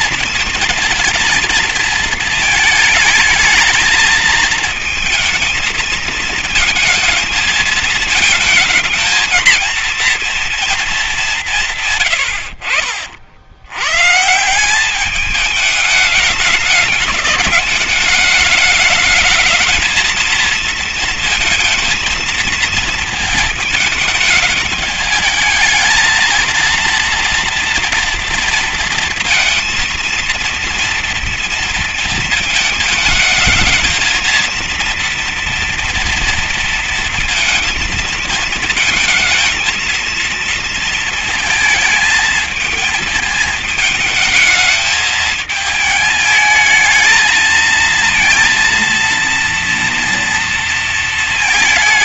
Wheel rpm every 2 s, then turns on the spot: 230, 220, 220, 230, 220, 220, 60, 180, 210, 210, 220, 220, 210, 230, 230, 230, 220, 230, 230, 220, 230, 220, 220, 220, 230, 230.
12-14